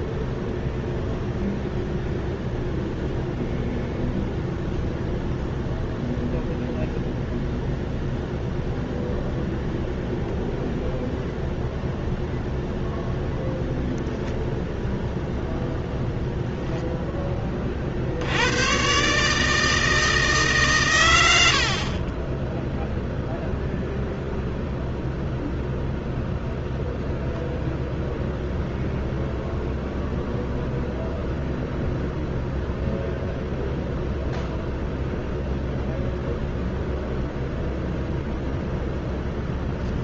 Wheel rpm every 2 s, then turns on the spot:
0, 0, 0, 0, 0, 0, 0, 0, 10, 110, 140, 10, 0, 0, 0, 0, 0, 0, 0, 0.
none